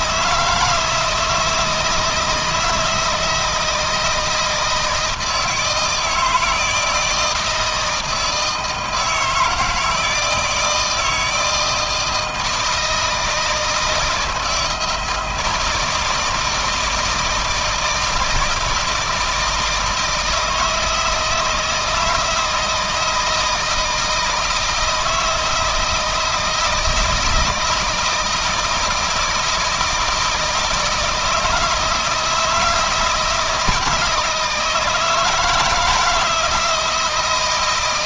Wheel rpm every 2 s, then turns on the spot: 160, 170, 160, 160, 160, 160, 160, 160, 160, 160, 160, 160, 160, 160, 160, 160, 160, 160, 160.
none